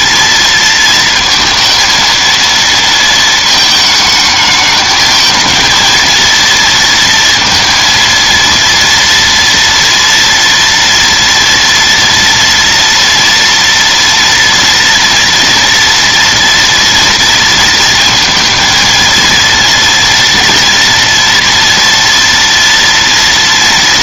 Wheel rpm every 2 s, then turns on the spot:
230, 230, 220, 230, 230, 230, 240, 230, 230, 230, 230, 230.
none